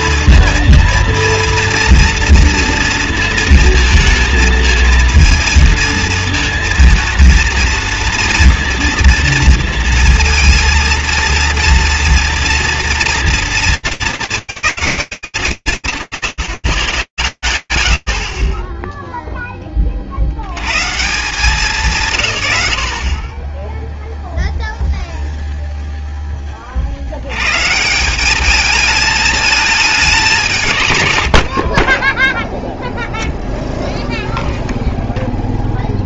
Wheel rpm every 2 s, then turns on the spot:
230, 230, 220, 230, 230, 230, 230, 220, 100, 0, 120, 70, 0, 50, 210, 130, 0, 0.
30-32